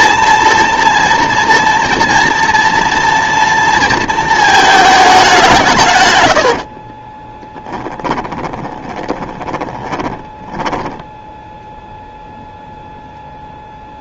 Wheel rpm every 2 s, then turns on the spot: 230, 230, 220, 40, 20, 10, 0.
6-12